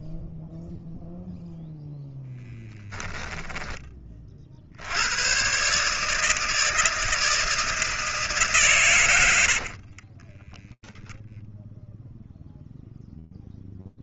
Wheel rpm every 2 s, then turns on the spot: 0, 40, 160, 160, 30, 0, 0.
8-10